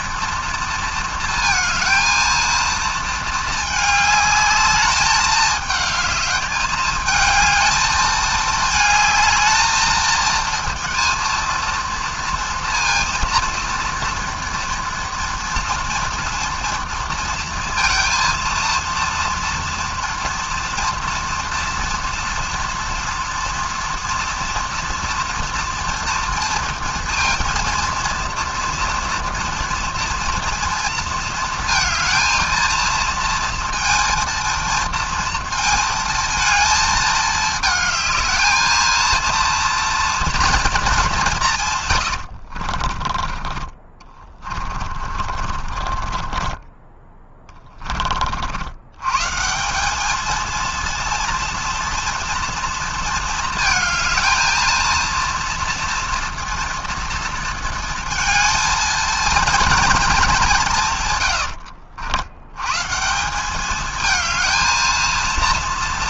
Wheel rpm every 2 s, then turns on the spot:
230, 230, 210, 210, 220, 230, 230, 230, 230, 230, 230, 230, 240, 230, 230, 230, 230, 230, 230, 220, 230, 60, 30, 20, 70, 230, 230, 230, 230, 230, 170, 110, 220.
42-48